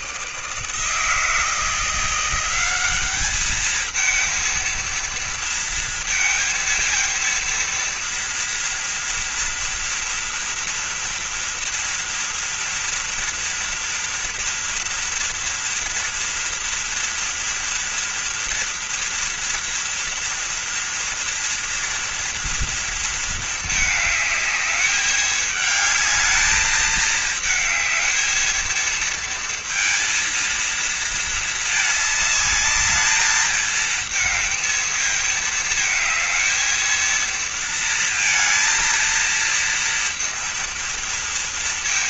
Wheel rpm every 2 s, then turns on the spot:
160, 190, 230, 220, 230, 230, 230, 230, 240, 230, 230, 230, 210, 210, 220, 230, 210, 220, 230, 230, 230.
none